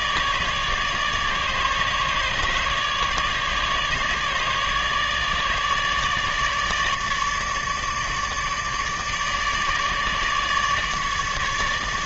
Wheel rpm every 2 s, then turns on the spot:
150, 150, 150, 150, 150, 150.
none